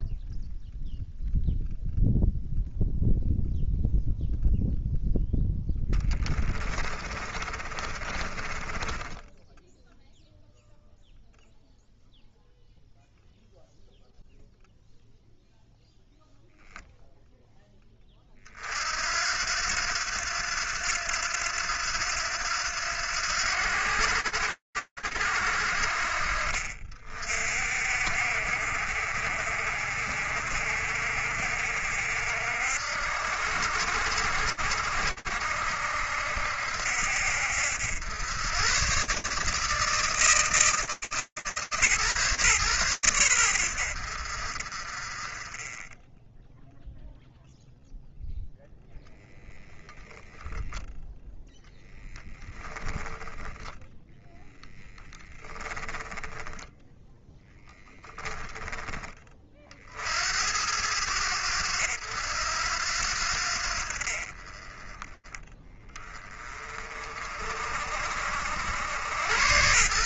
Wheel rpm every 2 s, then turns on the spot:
0, 0, 0, 10, 20, 0, 0, 0, 0, 30, 90, 90, 80, 50, 70, 60, 70, 70, 70, 130, 130, 90, 40, 0, 0, 0, 10, 10, 10, 50, 80, 50, 20, 60, 130.
6-10 52-56